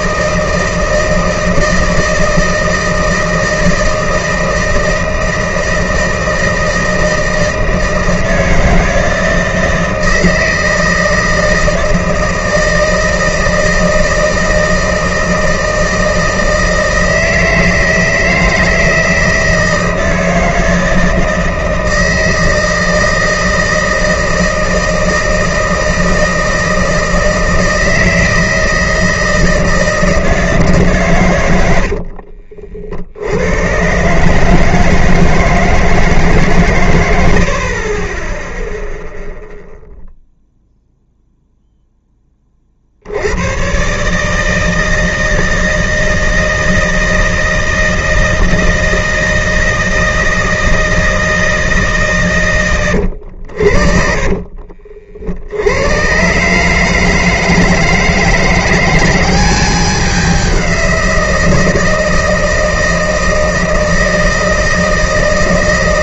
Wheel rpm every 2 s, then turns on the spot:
160, 160, 160, 160, 160, 160, 160, 160, 160, 160, 160, 160, 160, 160, 160, 160, 50, 140, 150, 10, 0, 20, 150, 160, 160, 160, 120, 40, 130, 170, 190, 160, 160.
32-34 54-56